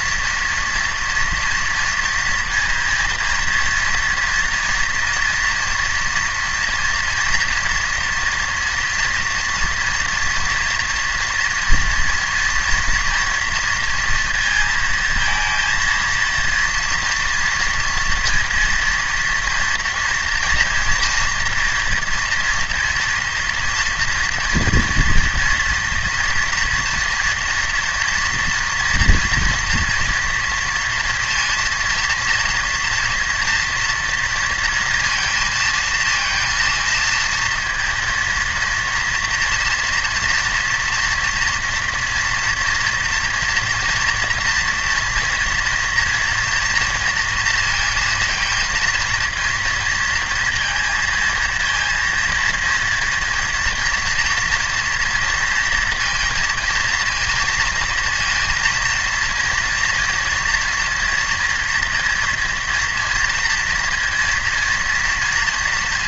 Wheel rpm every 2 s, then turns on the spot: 230, 230, 230, 230, 230, 230, 230, 230, 230, 230, 230, 230, 230, 230, 230, 230, 230, 230, 230, 230, 240, 230, 240, 240, 230, 230, 230, 230, 220, 230, 230, 230, 230.
none